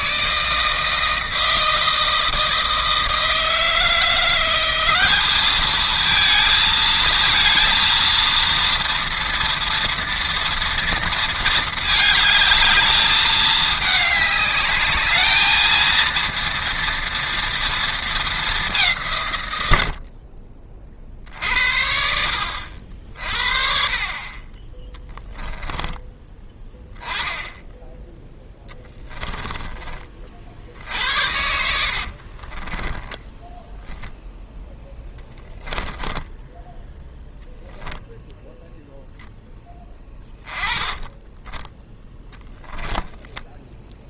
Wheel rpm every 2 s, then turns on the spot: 160, 160, 180, 230, 230, 230, 220, 210, 230, 200, 40, 60, 20, 10, 10, 60, 20, 10, 10, 0, 10, 10.
28-30 32-34 42-44